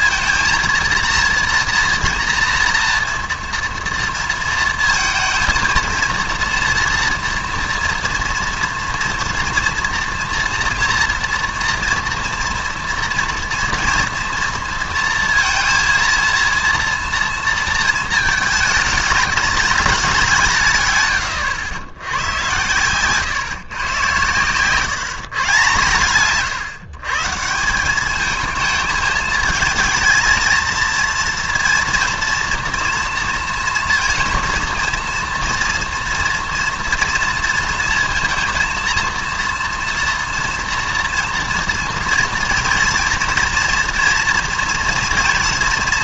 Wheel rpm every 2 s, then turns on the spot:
230, 230, 230, 230, 230, 230, 230, 230, 230, 220, 160, 110, 130, 130, 220, 230, 230, 230, 230, 230, 230, 230, 230.
none